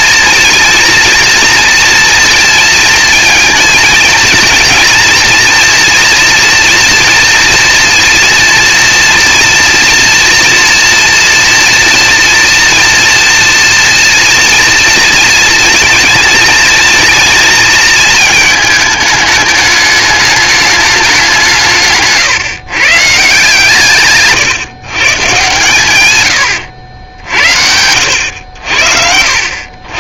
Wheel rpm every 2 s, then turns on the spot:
230, 230, 230, 240, 230, 230, 230, 230, 230, 220, 210, 140, 150, 110, 80.
26-28